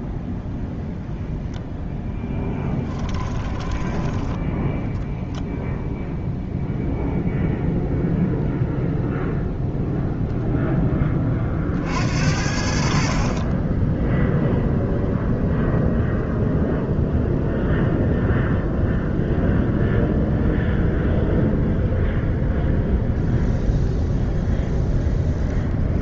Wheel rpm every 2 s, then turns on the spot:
0, 10, 10, 0, 0, 10, 60, 0, 0, 0, 0, 0, 0.
2-4